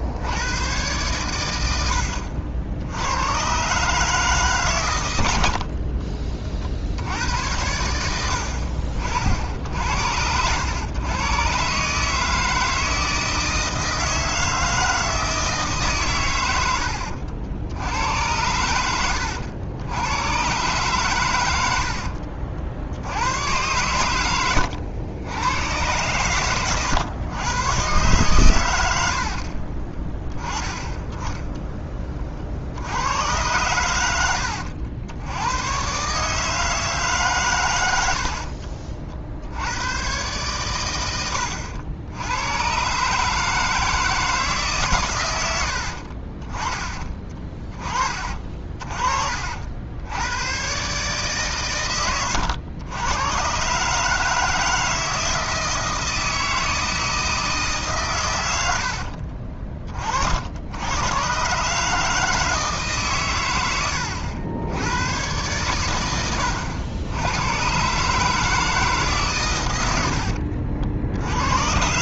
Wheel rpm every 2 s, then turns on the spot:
100, 70, 130, 50, 60, 100, 160, 160, 90, 90, 120, 70, 80, 110, 100, 20, 60, 90, 150, 50, 120, 110, 150, 30, 40, 120, 90, 160, 160, 80, 90, 160, 90, 90, 150, 60.
38-40 48-50